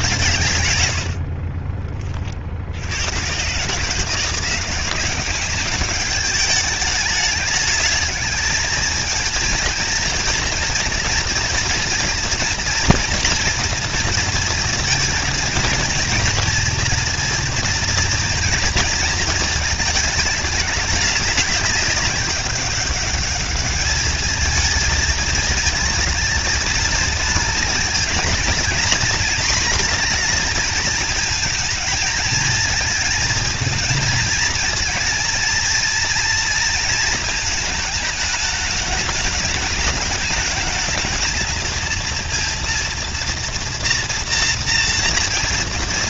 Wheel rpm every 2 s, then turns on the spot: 100, 90, 190, 210, 230, 230, 230, 220, 230, 230, 200, 200, 220, 220, 230, 220, 220, 230, 220, 210, 220, 230, 230.
0-2